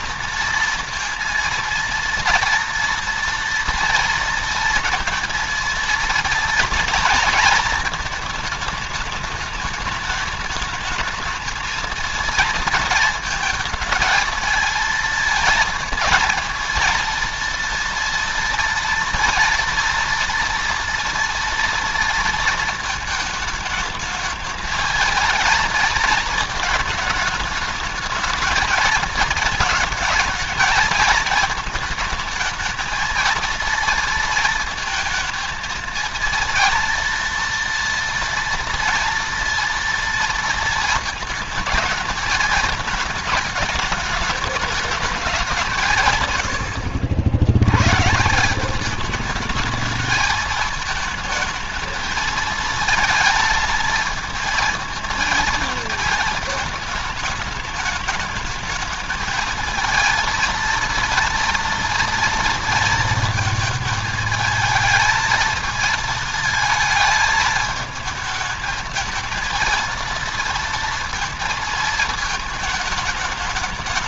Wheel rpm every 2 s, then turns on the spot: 230, 230, 230, 230, 220, 210, 230, 220, 230, 230, 230, 230, 220, 220, 220, 220, 220, 230, 230, 240, 230, 220, 210, 110, 170, 220, 230, 220, 220, 210, 230, 230, 220, 220, 220, 230, 220.
none